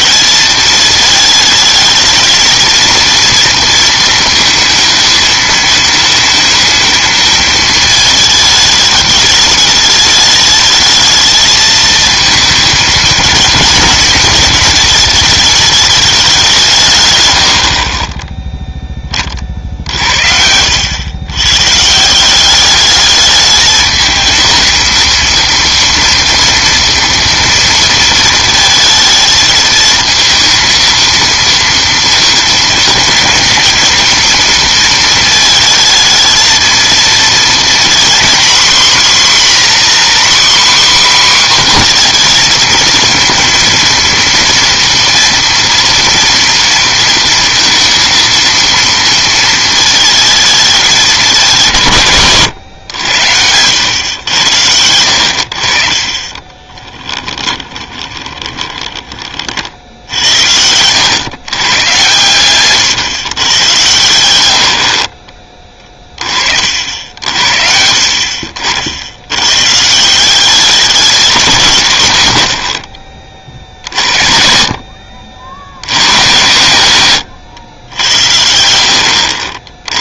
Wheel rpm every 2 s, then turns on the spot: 220, 220, 220, 220, 220, 220, 220, 220, 170, 10, 80, 200, 220, 230, 220, 230, 230, 230, 220, 250, 260, 230, 230, 230, 230, 220, 120, 100, 20, 20, 80, 130, 80, 50, 60, 190, 70, 50, 100, 70.
20-22 56-60 72-74